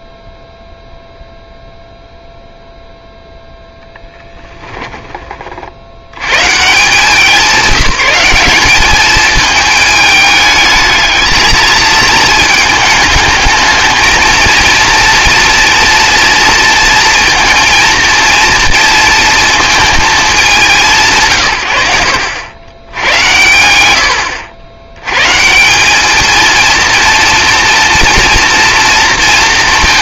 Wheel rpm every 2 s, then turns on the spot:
0, 0, 10, 160, 200, 220, 220, 230, 230, 230, 170, 90, 80, 230, 230.
4-6